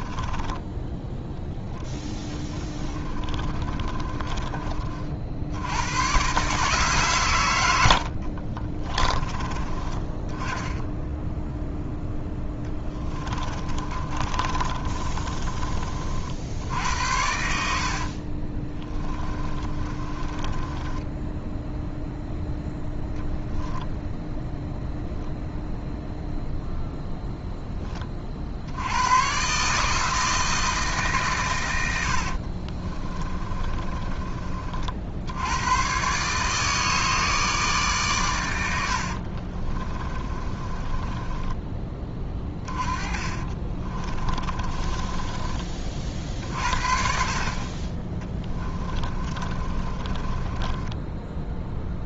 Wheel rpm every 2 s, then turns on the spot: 10, 20, 80, 100, 20, 0, 30, 40, 70, 20, 0, 0, 0, 10, 140, 120, 30, 40, 150, 90, 20, 20, 20, 50, 20, 20.
0-4 12-14 16-20 32-34 40-46 48-52